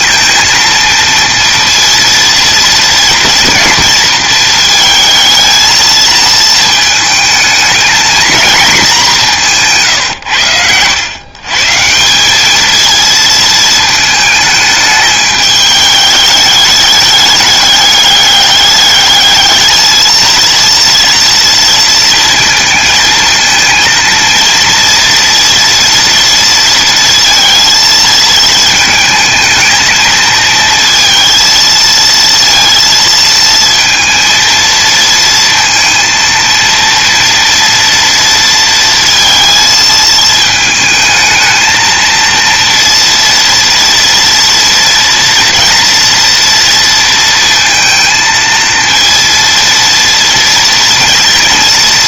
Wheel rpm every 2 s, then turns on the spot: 230, 230, 220, 220, 210, 110, 220, 210, 210, 210, 230, 220, 230, 230, 220, 230, 230, 230, 230, 230, 220, 230, 230, 230, 230, 230.
none